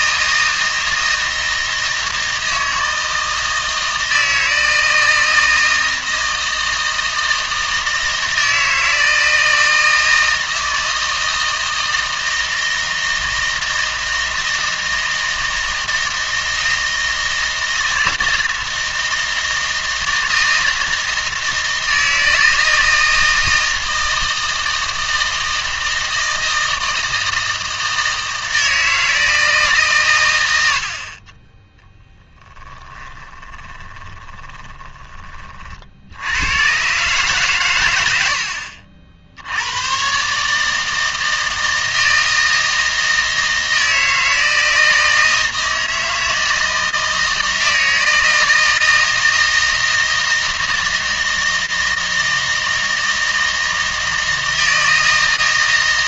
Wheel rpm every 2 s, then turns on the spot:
160, 160, 160, 160, 160, 160, 160, 160, 160, 160, 160, 160, 160, 160, 160, 60, 20, 20, 120, 60, 160, 160, 160, 160, 160, 160, 160, 160.
32-36